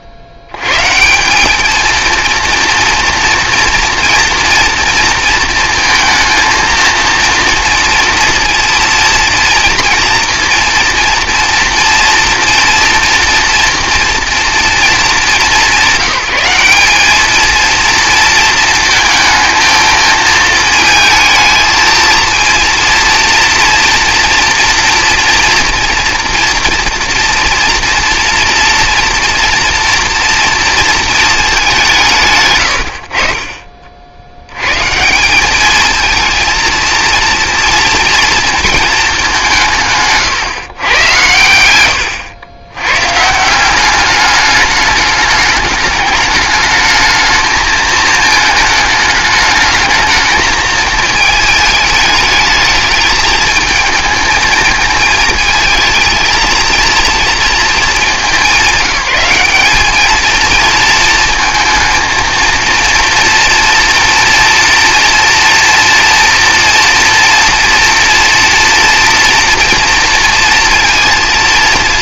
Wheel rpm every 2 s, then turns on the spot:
80, 230, 230, 230, 230, 230, 240, 220, 190, 220, 220, 230, 230, 230, 230, 230, 100, 110, 230, 230, 120, 110, 210, 220, 220, 220, 220, 220, 230, 200, 230, 230, 230, 240, 230, 230.
none